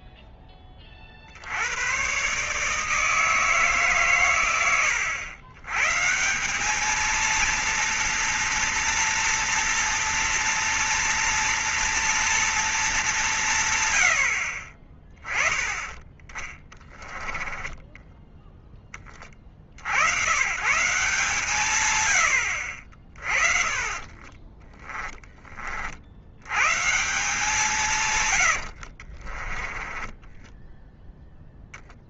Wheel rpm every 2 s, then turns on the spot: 30, 150, 100, 210, 230, 230, 200, 40, 20, 20, 140, 50, 20, 140, 60, 0.
16-18 28-30